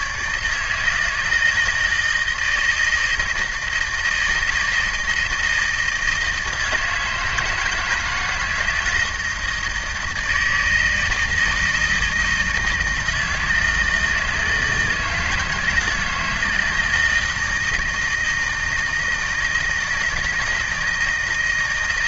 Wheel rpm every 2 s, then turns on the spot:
150, 160, 160, 160, 160, 160, 160, 160, 160, 160, 160.
none